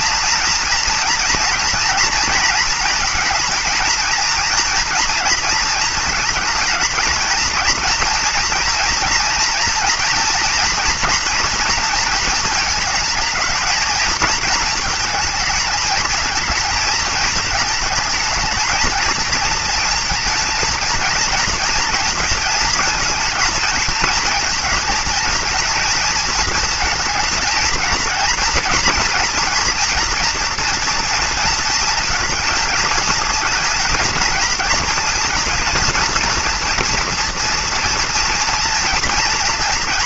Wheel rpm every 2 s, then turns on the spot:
240, 230, 230, 230, 230, 240, 220, 220, 220, 220, 230, 230, 230, 230, 230, 230, 220, 230, 230, 240.
none